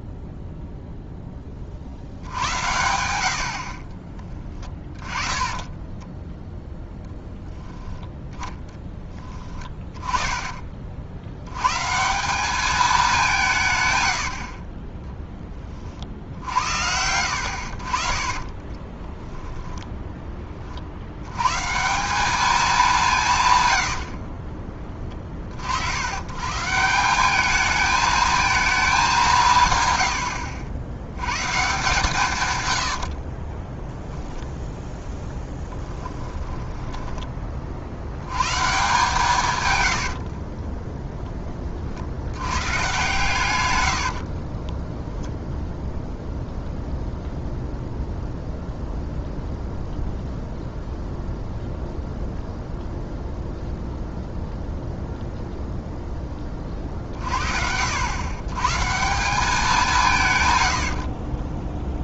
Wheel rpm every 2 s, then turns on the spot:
0, 90, 20, 0, 10, 40, 210, 30, 70, 20, 50, 210, 20, 160, 220, 80, 110, 0, 10, 140, 20, 120, 20, 0, 0, 0, 0, 0, 30, 150, 80.
4-6 8-10 14-16 18-20 36-38 40-42 44-46 60-62